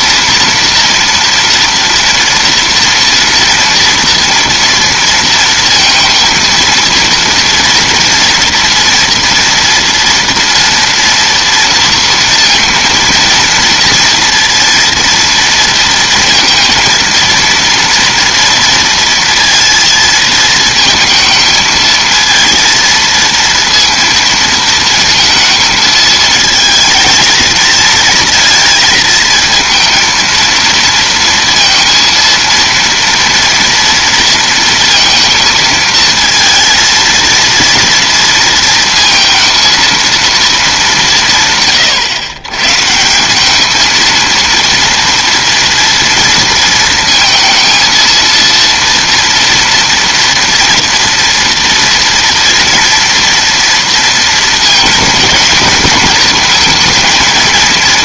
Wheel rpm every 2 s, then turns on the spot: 230, 230, 230, 230, 230, 230, 230, 230, 230, 230, 220, 230, 220, 220, 230, 230, 230, 230, 230, 230, 180, 170, 230, 230, 230, 230, 230, 220, 220.
none